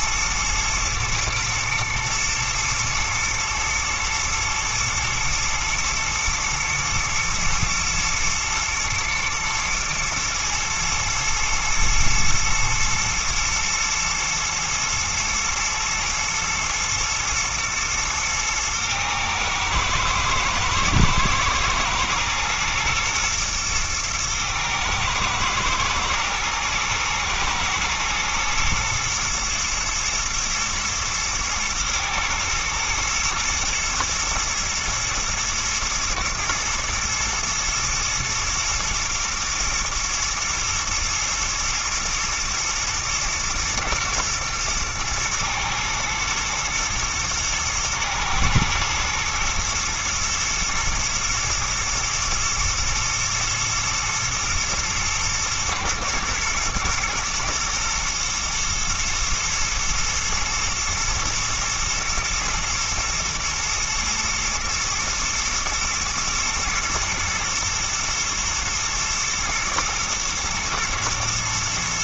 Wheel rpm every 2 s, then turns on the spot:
110, 120, 110, 120, 110, 120, 120, 120, 120, 110, 110, 110, 110, 110, 120, 110, 110, 110, 120, 120, 120, 110, 110, 110, 110, 120, 120, 110, 110, 120, 120, 120, 120, 120, 110, 120.
none